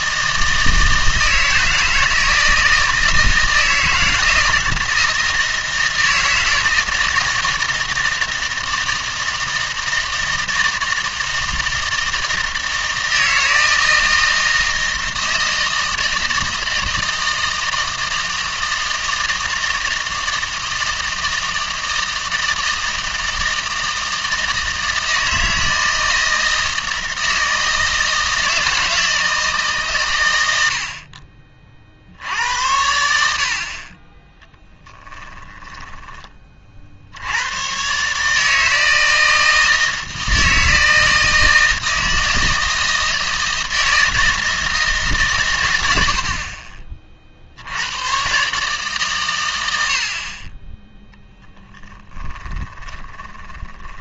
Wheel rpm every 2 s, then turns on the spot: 160, 160, 160, 160, 160, 160, 160, 160, 160, 160, 160, 160, 160, 160, 160, 70, 70, 10, 50, 160, 160, 160, 160, 40, 140, 10, 20.
34-36 52-54